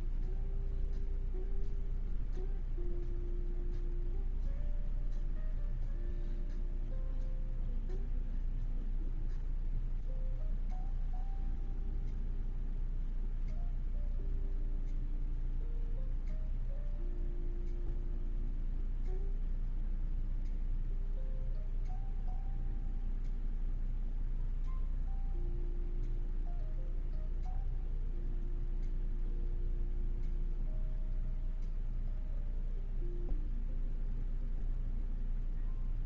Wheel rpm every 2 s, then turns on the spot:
0, 0, 0, 0, 0, 0, 0, 0, 0, 0, 0, 0, 0, 0, 0, 0, 0, 0.
none